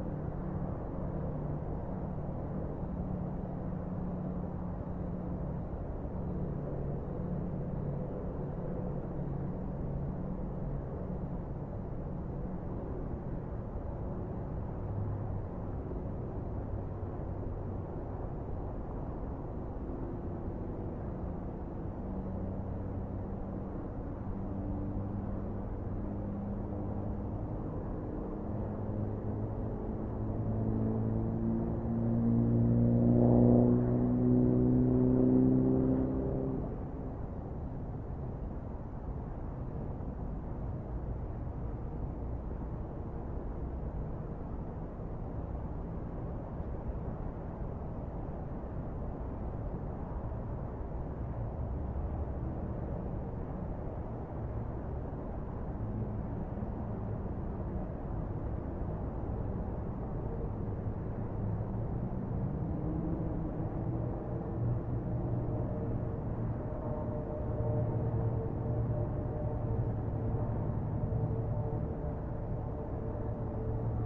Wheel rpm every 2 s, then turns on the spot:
0, 0, 0, 0, 0, 0, 0, 0, 0, 0, 0, 0, 0, 0, 0, 0, 0, 0, 0, 0, 0, 0, 0, 0, 0, 0, 0, 0, 0, 0, 0, 0, 0, 0, 0, 0, 0.
none